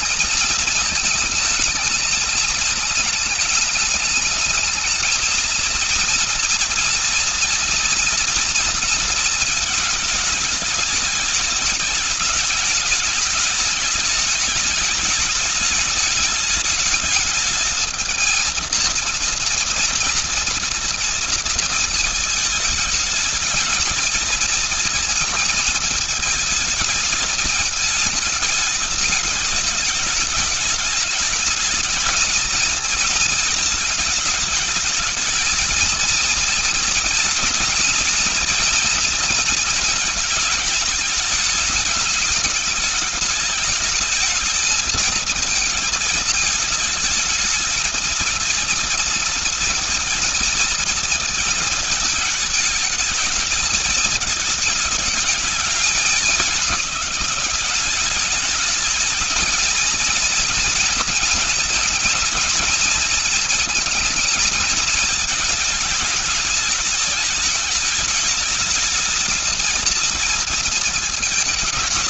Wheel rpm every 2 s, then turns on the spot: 220, 220, 210, 230, 230, 210, 210, 210, 210, 220, 230, 220, 220, 220, 220, 210, 230, 220, 230, 230, 220, 220, 220, 220, 230, 230, 220, 220, 200, 200, 230, 230, 220, 210, 220, 230.
none